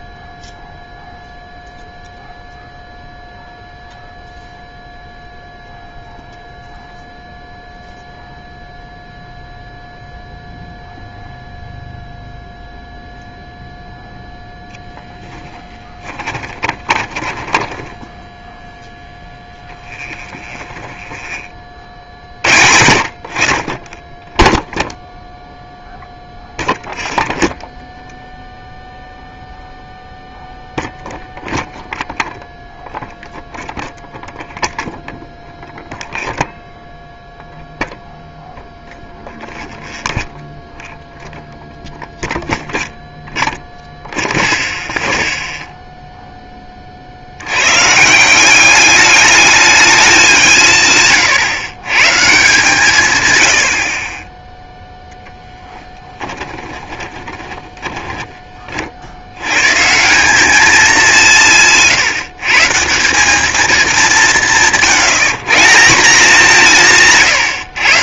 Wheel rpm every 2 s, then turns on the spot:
0, 0, 0, 0, 0, 0, 0, 10, 20, 10, 20, 50, 0, 0, 0, 0, 0, 0, 0, 0, 0, 0, 0, 10, 190, 180, 150, 0, 10, 30, 210, 150, 180, 180.
14-22 56-58